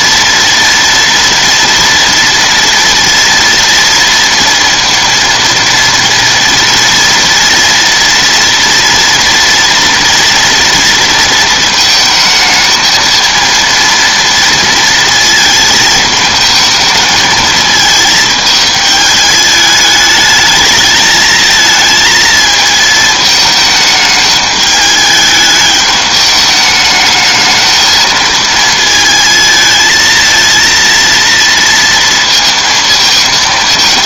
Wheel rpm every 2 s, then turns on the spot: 230, 230, 230, 230, 230, 230, 220, 230, 220, 220, 220, 220, 210, 210, 220, 230, 230.
none